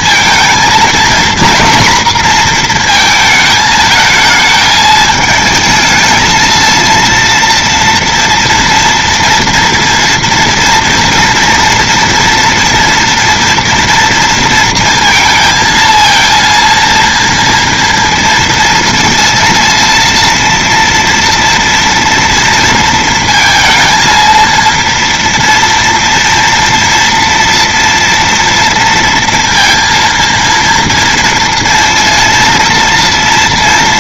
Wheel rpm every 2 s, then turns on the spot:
220, 230, 220, 220, 230, 230, 240, 230, 230, 230, 230, 230, 230, 230, 230, 230, 230.
none